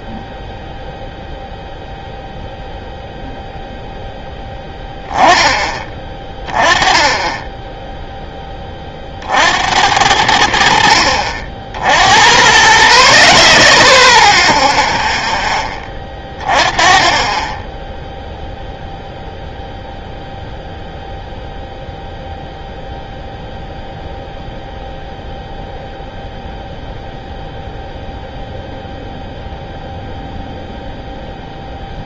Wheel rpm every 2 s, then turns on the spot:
0, 0, 10, 20, 20, 70, 50, 0, 20, 0, 0, 0, 0, 0, 0, 0.
none